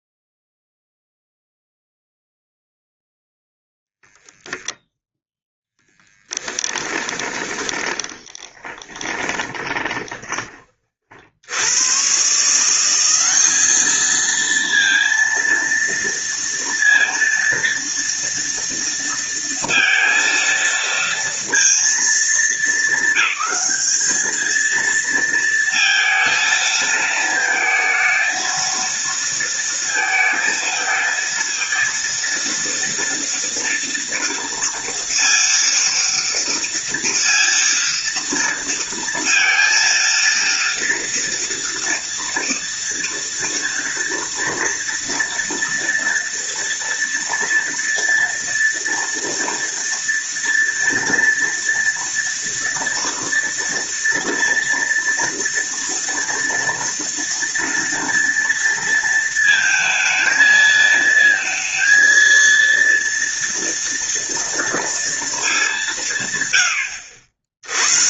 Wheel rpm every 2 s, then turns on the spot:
0, 0, 0, 10, 10, 30, 170, 230, 230, 230, 230, 200, 220, 230, 230, 230, 230, 230, 230, 230, 230, 230, 230, 230, 230, 230, 230, 230, 230, 230, 220, 230, 230, 90.
6-10